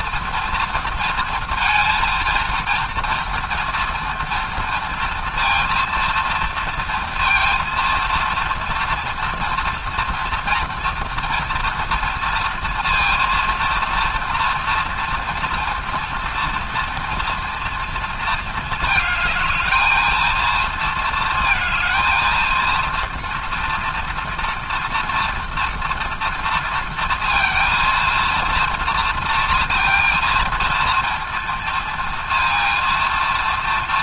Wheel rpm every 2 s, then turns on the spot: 230, 230, 230, 230, 230, 240, 230, 230, 230, 220, 230, 230, 230, 230, 230, 230, 230.
none